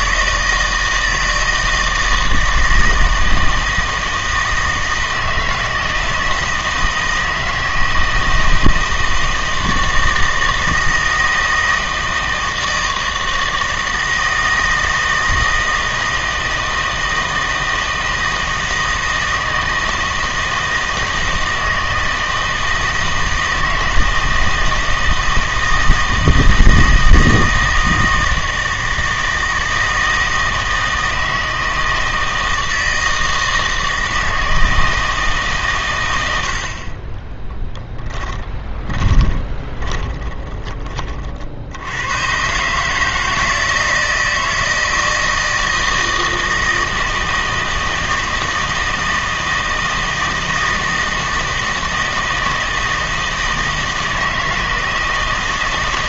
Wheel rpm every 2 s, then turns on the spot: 160, 160, 160, 160, 160, 160, 160, 160, 160, 160, 160, 160, 160, 160, 160, 160, 160, 160, 60, 20, 20, 140, 160, 160, 160, 160, 160, 160.
38-40